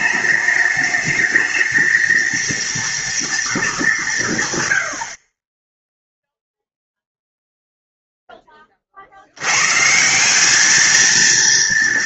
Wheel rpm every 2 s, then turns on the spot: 210, 230, 100, 0, 30, 210.
none